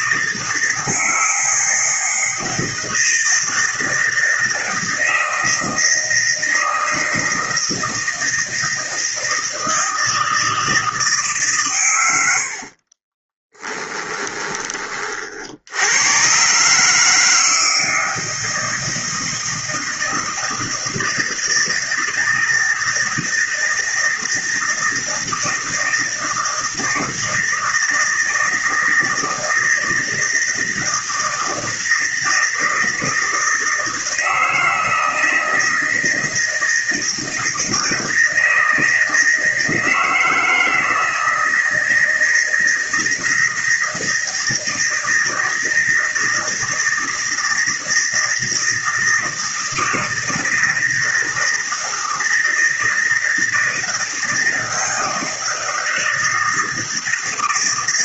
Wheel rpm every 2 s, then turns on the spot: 160, 160, 160, 160, 160, 160, 70, 20, 130, 160, 160, 160, 160, 160, 160, 160, 160, 160, 160, 160, 160, 160, 160, 160, 160, 160, 160, 160, 160.
none